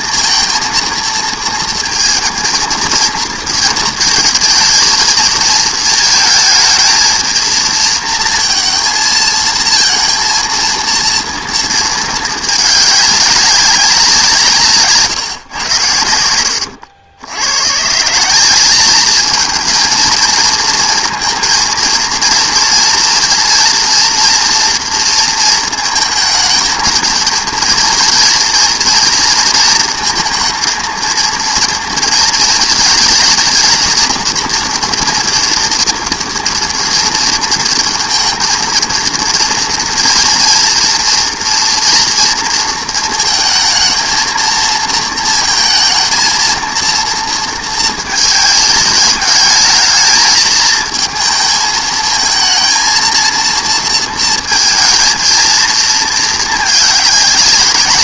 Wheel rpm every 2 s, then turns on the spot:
230, 230, 220, 220, 230, 230, 210, 160, 90, 200, 230, 230, 230, 220, 230, 230, 230, 230, 230, 230, 230, 230, 220, 230, 220, 220, 220, 230, 220.
16-18